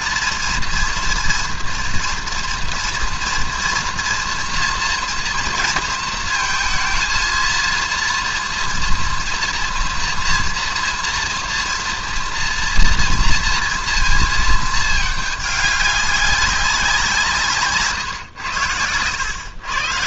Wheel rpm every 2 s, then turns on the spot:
230, 230, 230, 230, 230, 230, 230, 220, 180, 100.
none